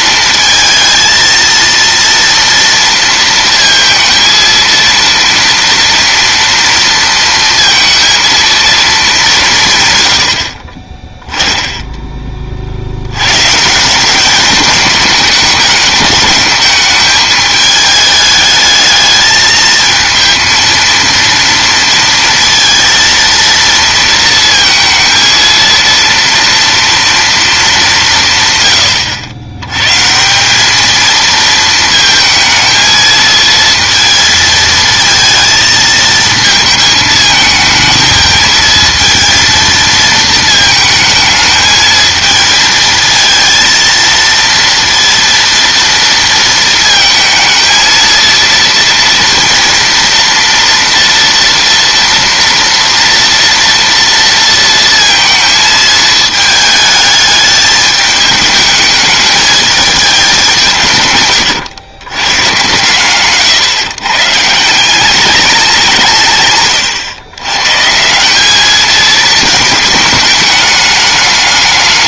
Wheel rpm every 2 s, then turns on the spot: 230, 230, 230, 230, 230, 50, 50, 210, 210, 220, 230, 230, 230, 230, 120, 190, 220, 220, 220, 220, 220, 220, 230, 230, 230, 230, 230, 230, 220, 210, 170, 130, 170, 130, 210, 210.
none